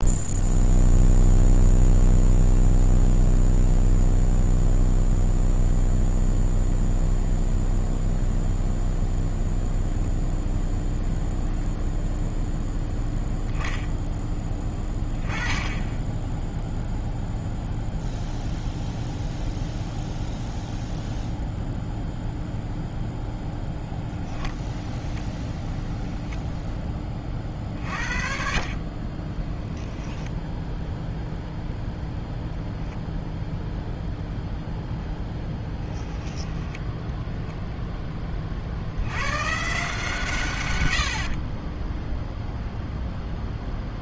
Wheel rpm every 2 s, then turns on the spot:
0, 0, 0, 0, 0, 0, 0, 10, 0, 0, 0, 0, 0, 0, 50, 0, 0, 0, 10, 40, 140, 0.
36-38